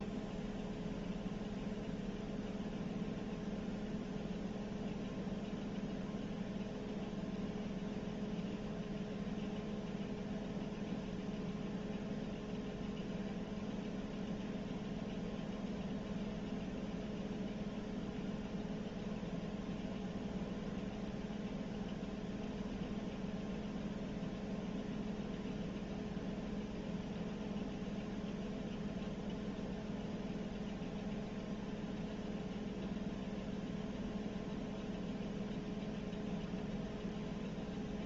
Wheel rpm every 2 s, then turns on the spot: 0, 0, 0, 0, 0, 0, 0, 0, 0, 0, 0, 0, 0, 0, 0, 0, 0, 0, 0.
none